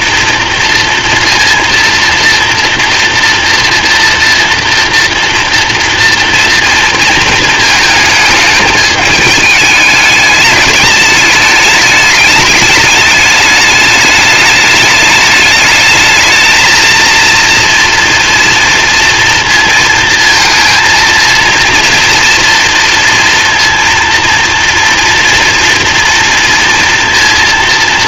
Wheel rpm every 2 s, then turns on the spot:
230, 230, 230, 230, 210, 210, 210, 210, 220, 240, 230, 230, 230, 230.
none